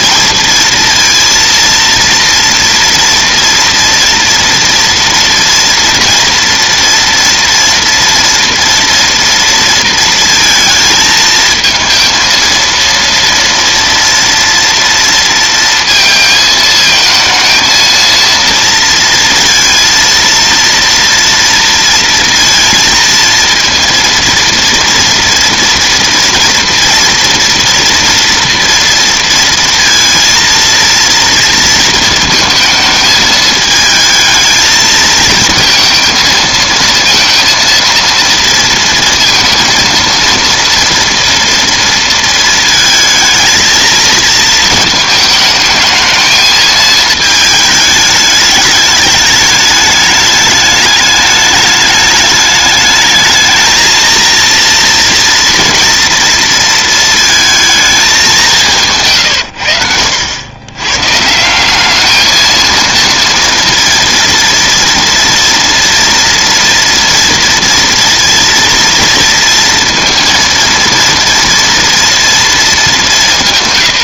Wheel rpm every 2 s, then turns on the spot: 230, 230, 230, 230, 230, 230, 230, 230, 220, 230, 230, 230, 230, 230, 230, 230, 220, 220, 220, 230, 230, 220, 220, 220, 210, 210, 210, 230, 230, 160, 120, 230, 230, 230, 230, 230, 210.
58-60